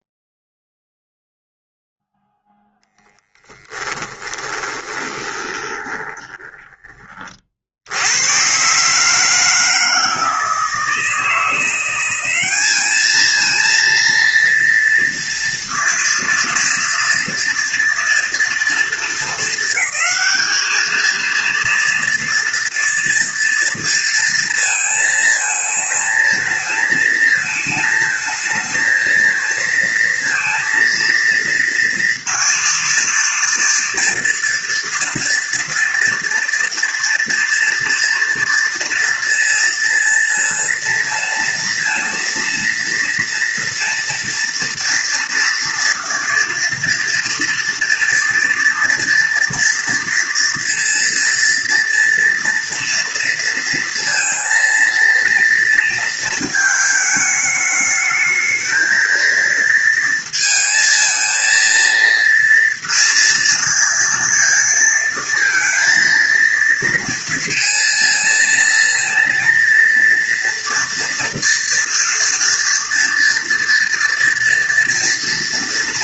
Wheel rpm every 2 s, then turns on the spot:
0, 10, 20, 20, 150, 160, 220, 230, 230, 220, 220, 230, 220, 220, 230, 230, 230, 230, 240, 230, 230, 230, 230, 230, 230, 230, 230, 230, 220, 220, 220, 230, 230, 230, 230, 240, 230, 230.
4-6